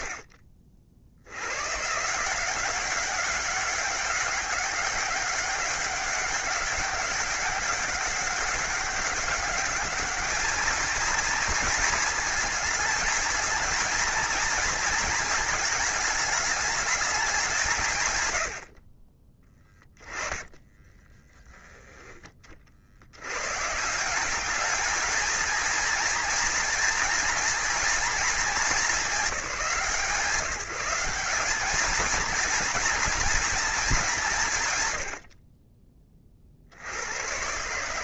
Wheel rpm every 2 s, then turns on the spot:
60, 190, 200, 200, 200, 220, 220, 230, 200, 50, 10, 60, 220, 240, 210, 180, 230, 110, 90.
20-22